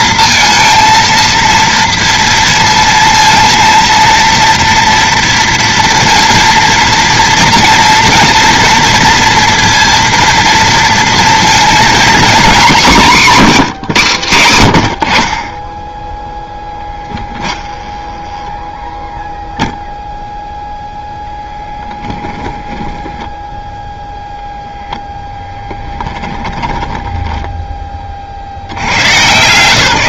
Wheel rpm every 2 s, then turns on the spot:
230, 230, 230, 230, 230, 230, 230, 100, 10, 10, 0, 10, 0, 20, 80.
16-20 22-24 26-28